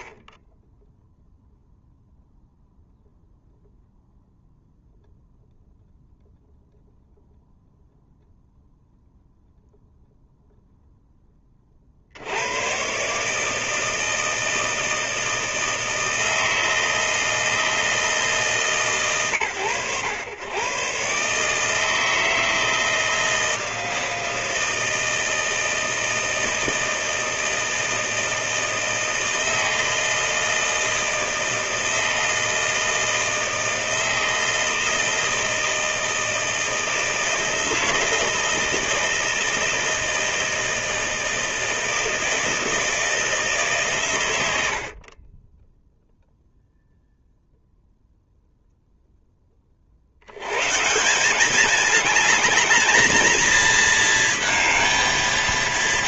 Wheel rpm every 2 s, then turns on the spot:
0, 0, 0, 0, 0, 30, 150, 160, 160, 110, 150, 160, 160, 160, 160, 160, 160, 160, 160, 160, 160, 160, 30, 0, 0, 170, 210, 220.
none